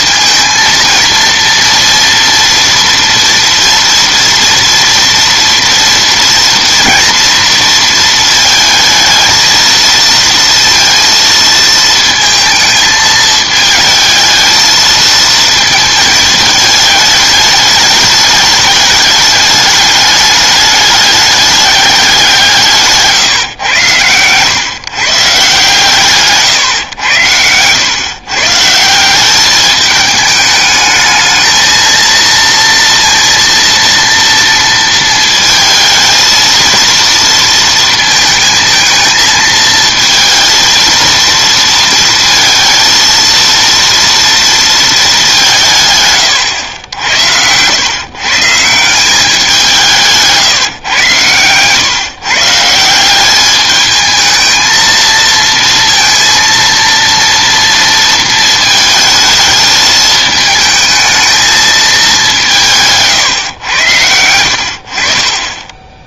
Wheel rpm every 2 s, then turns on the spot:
230, 230, 240, 230, 220, 230, 220, 220, 220, 210, 210, 160, 130, 130, 160, 210, 230, 230, 230, 220, 230, 230, 230, 100, 160, 140, 160, 220, 230, 220, 220, 170, 70.
none